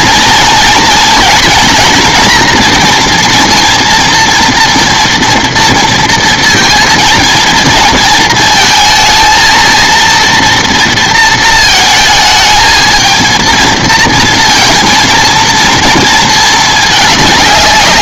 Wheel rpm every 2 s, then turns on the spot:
230, 230, 230, 220, 220, 230, 220, 230, 210.
none